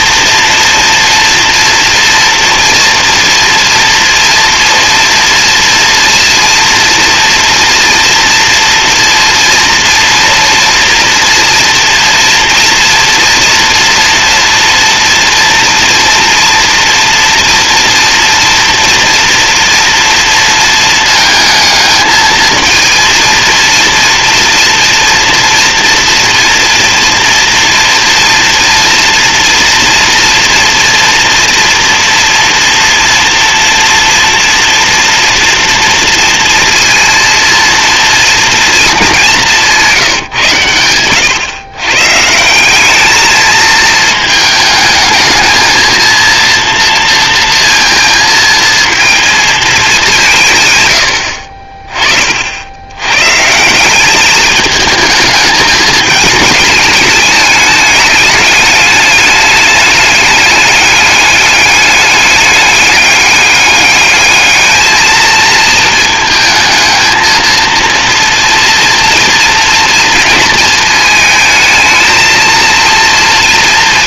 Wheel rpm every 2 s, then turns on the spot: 230, 230, 230, 230, 240, 230, 240, 230, 230, 230, 220, 230, 230, 230, 230, 230, 230, 230, 230, 210, 110, 200, 210, 230, 230, 90, 90, 210, 220, 210, 210, 200, 220, 220, 230, 220, 230.
none